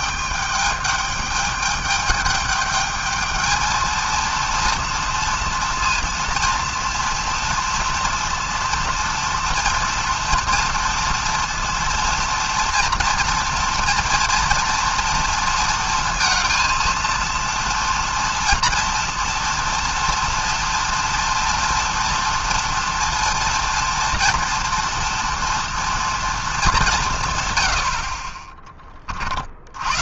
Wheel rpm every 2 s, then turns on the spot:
200, 210, 230, 230, 230, 230, 230, 230, 230, 230, 240, 230, 240, 210, 40.
none